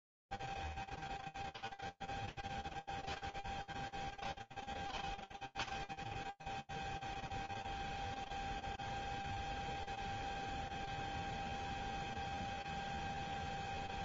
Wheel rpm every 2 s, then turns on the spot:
0, 0, 0, 0, 0, 0, 0.
none